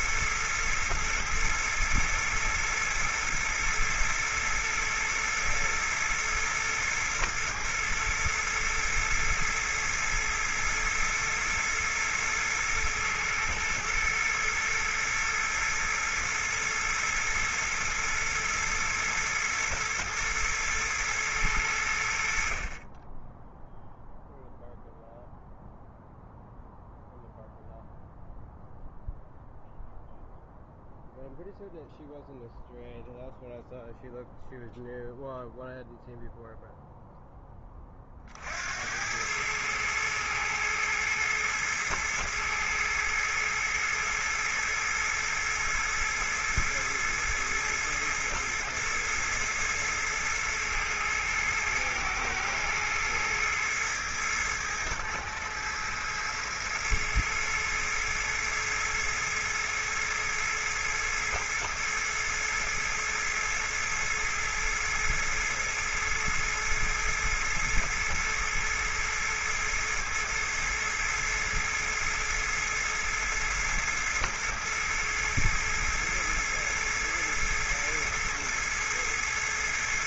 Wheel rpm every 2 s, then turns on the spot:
110, 120, 110, 120, 110, 110, 110, 120, 110, 110, 110, 30, 0, 0, 0, 0, 0, 0, 0, 70, 110, 110, 110, 110, 110, 110, 110, 110, 110, 110, 110, 110, 110, 110, 110, 110, 110, 110, 110, 110.
none